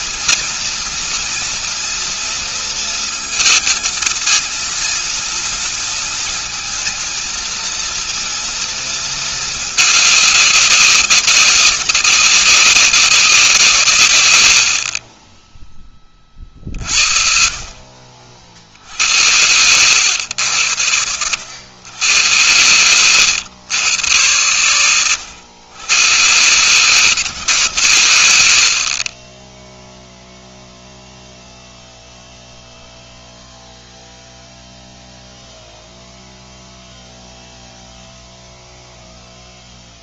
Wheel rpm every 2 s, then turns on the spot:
240, 230, 230, 230, 230, 200, 190, 100, 30, 50, 100, 110, 110, 120, 110, 0, 0, 0, 0, 0.
none